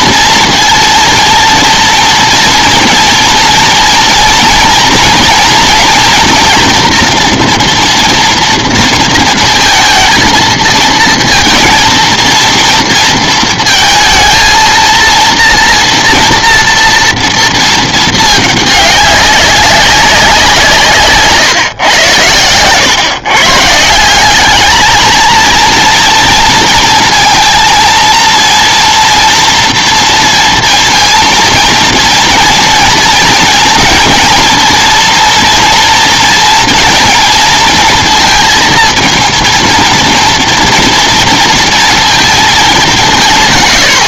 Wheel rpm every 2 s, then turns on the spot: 230, 230, 230, 240, 230, 230, 230, 230, 230, 210, 170, 110, 210, 230, 230, 230, 230, 230, 230, 230, 230, 210.
none